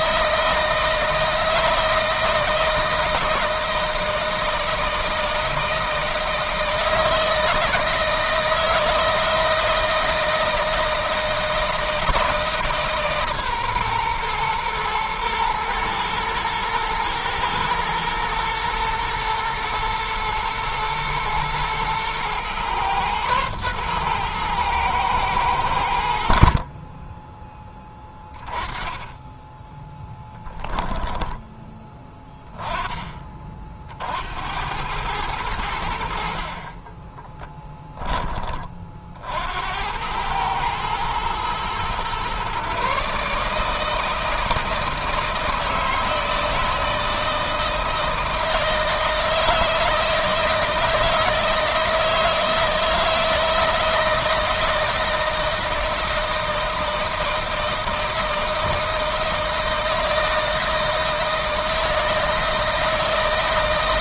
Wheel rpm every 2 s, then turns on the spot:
160, 170, 160, 160, 160, 160, 150, 120, 120, 120, 110, 120, 110, 40, 30, 10, 10, 90, 30, 30, 110, 140, 160, 160, 160, 160, 160, 170, 160, 160, 160, 160.
30-32 36-38